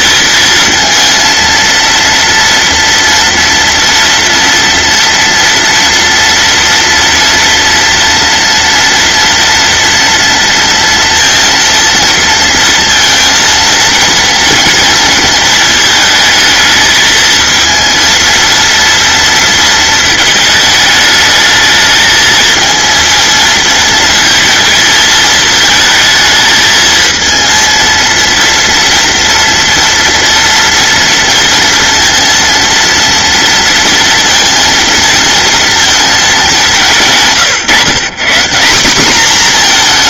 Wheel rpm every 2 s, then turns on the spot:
230, 230, 230, 230, 240, 230, 230, 230, 220, 220, 230, 210, 230, 220, 220, 230, 230, 230, 230, 150.
none